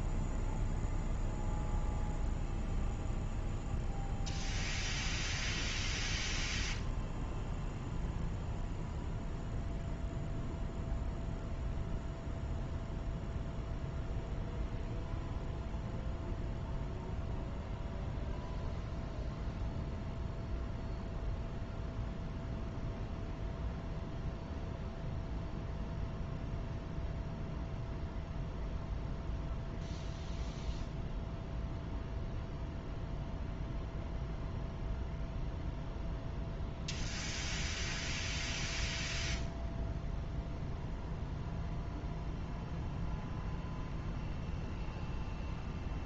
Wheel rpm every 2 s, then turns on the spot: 0, 0, 0, 0, 0, 0, 0, 0, 0, 0, 0, 0, 0, 0, 0, 0, 0, 0, 0, 0, 0, 0, 0.
none